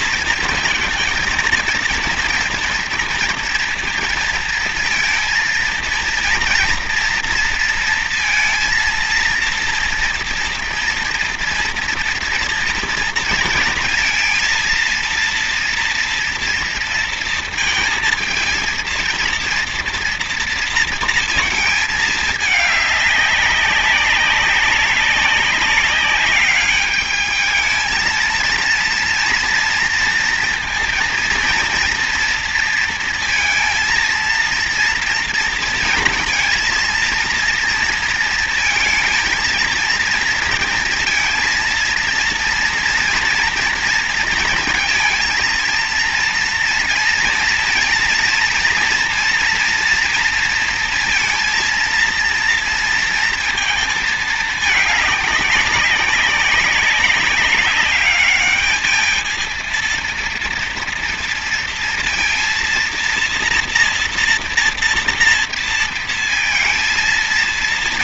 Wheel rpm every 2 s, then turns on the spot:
230, 230, 230, 230, 230, 230, 230, 230, 230, 230, 230, 210, 190, 200, 230, 230, 230, 230, 230, 230, 230, 230, 230, 230, 230, 230, 230, 220, 200, 210, 230, 230, 230, 220.
none